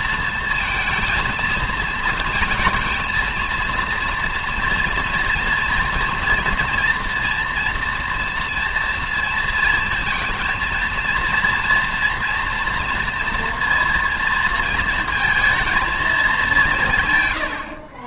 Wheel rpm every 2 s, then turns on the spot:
230, 230, 230, 230, 230, 230, 230, 230, 110.
none